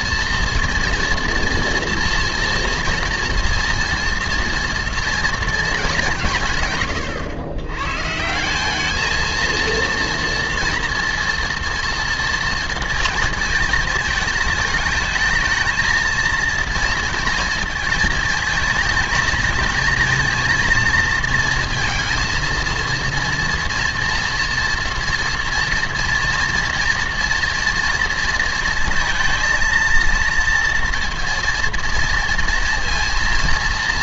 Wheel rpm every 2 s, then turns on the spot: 230, 240, 230, 140, 190, 240, 230, 220, 230, 220, 230, 230, 230, 230, 230, 230, 230.
none